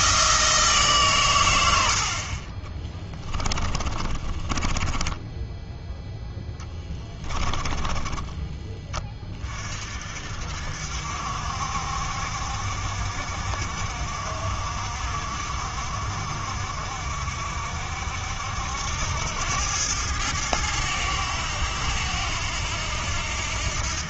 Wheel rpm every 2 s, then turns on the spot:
150, 30, 20, 10, 20, 60, 60, 60, 60, 80, 100, 90.
2-8